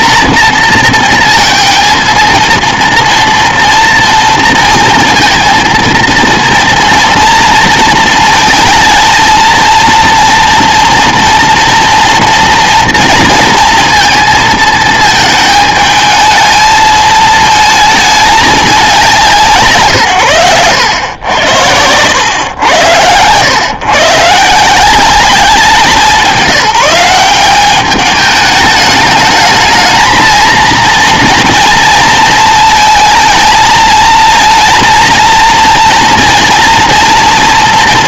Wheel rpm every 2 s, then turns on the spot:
230, 230, 230, 230, 220, 230, 230, 220, 220, 190, 100, 100, 180, 190, 210, 230, 230, 230, 230.
none